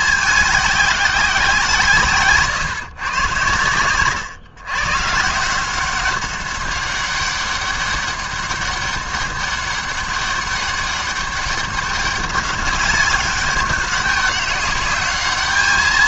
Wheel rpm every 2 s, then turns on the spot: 200, 130, 130, 200, 200, 200, 200, 200.
none